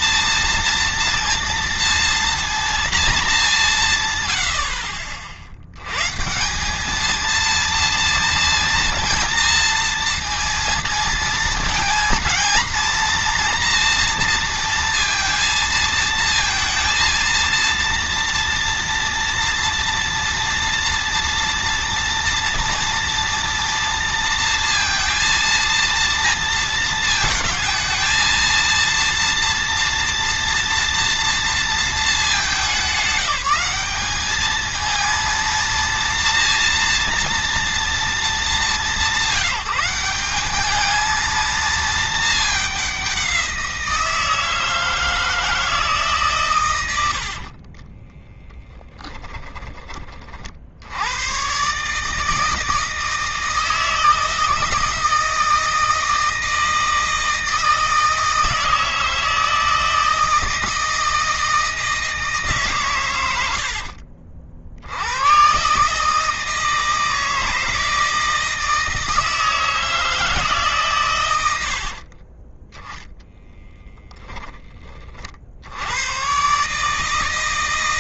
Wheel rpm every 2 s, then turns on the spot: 230, 230, 60, 210, 230, 230, 230, 230, 230, 230, 230, 230, 230, 220, 230, 230, 200, 220, 240, 190, 220, 190, 160, 100, 10, 90, 160, 160, 160, 160, 160, 120, 90, 160, 160, 130, 10, 40, 150.
46-50